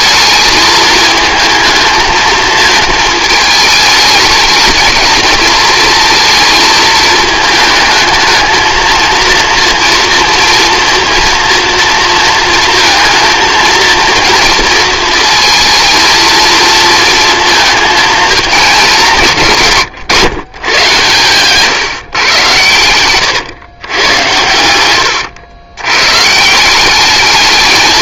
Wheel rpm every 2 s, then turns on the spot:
210, 220, 220, 220, 220, 230, 230, 230, 230, 220, 140, 120, 90, 150.
none